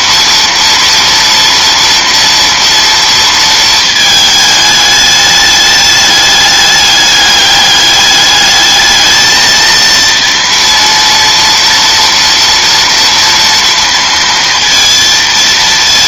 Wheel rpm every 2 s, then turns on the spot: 230, 230, 210, 210, 210, 230, 230, 230.
none